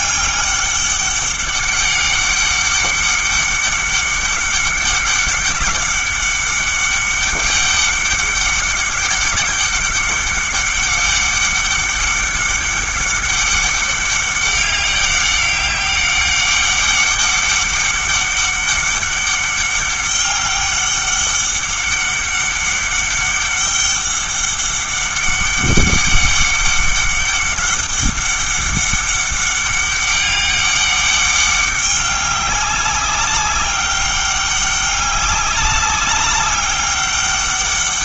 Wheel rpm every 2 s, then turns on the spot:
200, 200, 200, 200, 200, 200, 200, 200, 200, 200, 200, 200, 200, 200, 200, 200, 200, 190, 200.
none